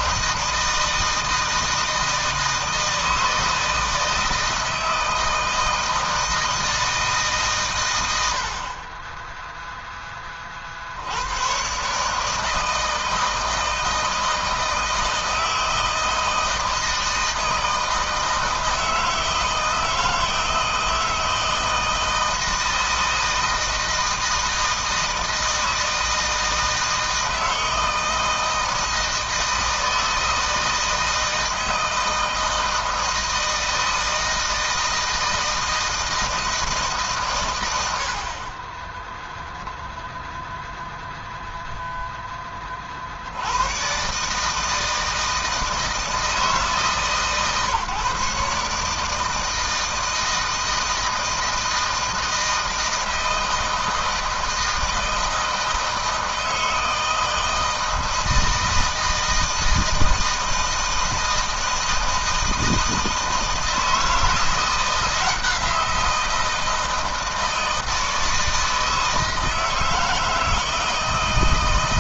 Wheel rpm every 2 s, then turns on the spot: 160, 160, 160, 160, 70, 40, 160, 160, 160, 160, 160, 160, 160, 160, 160, 160, 160, 160, 160, 50, 10, 20, 150, 160, 140, 160, 160, 160, 160, 160, 160, 160, 170, 170, 160, 160.
38-40